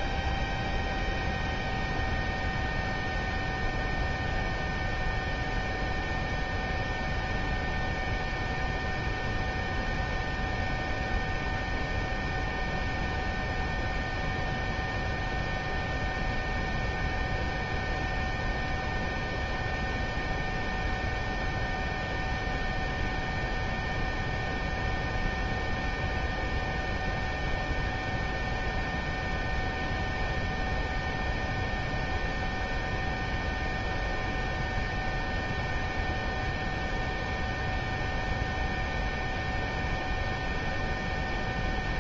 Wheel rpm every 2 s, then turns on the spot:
0, 0, 0, 0, 0, 0, 0, 0, 0, 0, 0, 0, 0, 0, 0, 0, 0, 0, 0, 0, 0.
none